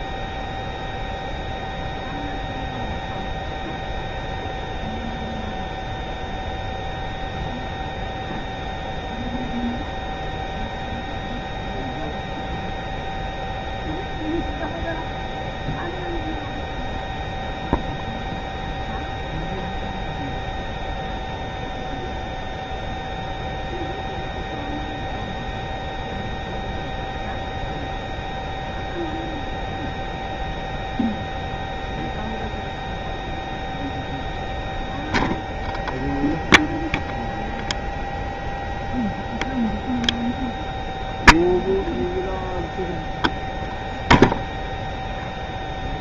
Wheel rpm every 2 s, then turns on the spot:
0, 0, 0, 0, 0, 0, 0, 0, 0, 0, 0, 0, 0, 0, 0, 0, 0, 0, 0, 0, 0, 0, 0.
none